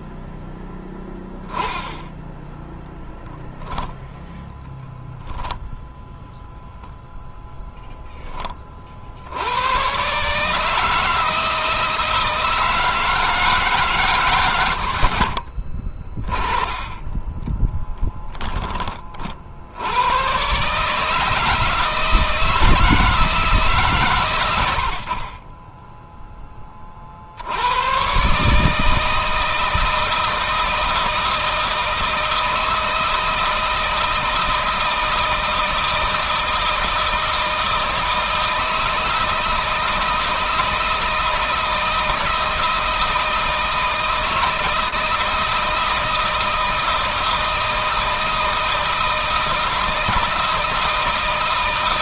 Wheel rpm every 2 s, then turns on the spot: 10, 10, 0, 0, 50, 160, 160, 70, 20, 20, 150, 160, 80, 40, 150, 160, 160, 160, 160, 160, 170, 160, 160, 160, 160, 160.
14-16